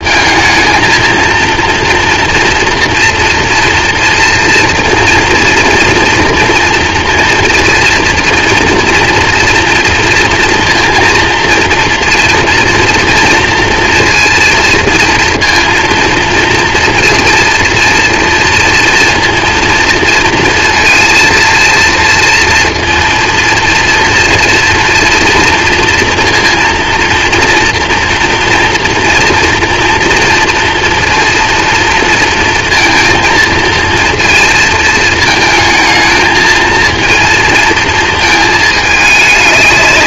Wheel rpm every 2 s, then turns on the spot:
220, 230, 230, 230, 230, 230, 230, 230, 230, 230, 230, 230, 230, 230, 240, 230, 230, 220, 220, 220.
none